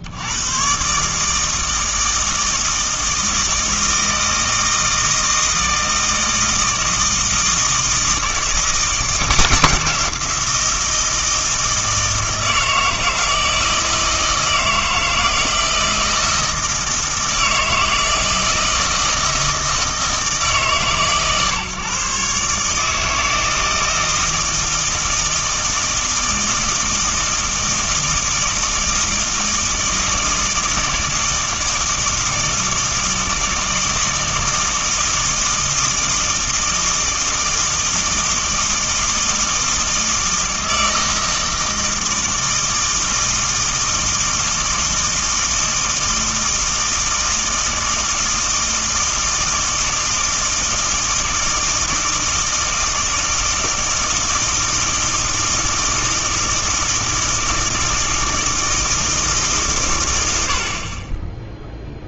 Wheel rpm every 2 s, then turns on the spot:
90, 160, 160, 160, 170, 170, 160, 160, 160, 160, 140, 150, 160, 160, 160, 160, 160, 160, 160, 160, 160, 160, 160, 160, 160, 160, 160, 160, 160, 160, 50.
none